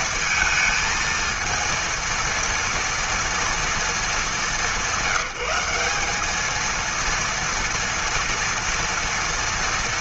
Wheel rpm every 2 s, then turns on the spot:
230, 230, 180, 230, 230.
none